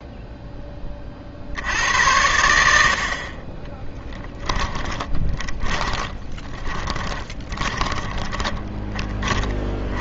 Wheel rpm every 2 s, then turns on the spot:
10, 80, 20, 20, 20.
4-8